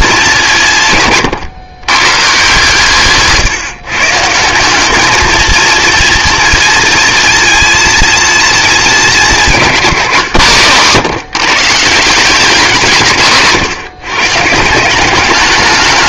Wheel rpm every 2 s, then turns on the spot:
150, 140, 190, 230, 220, 140, 180, 170.
none